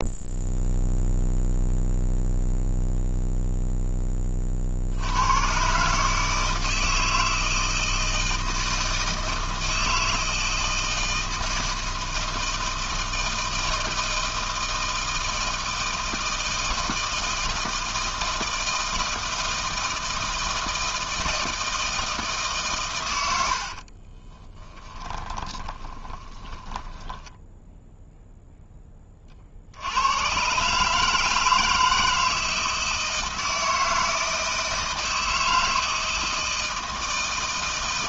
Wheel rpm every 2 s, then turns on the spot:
0, 0, 50, 160, 160, 160, 160, 160, 160, 160, 160, 130, 10, 10, 10, 130, 160, 160, 160.
24-28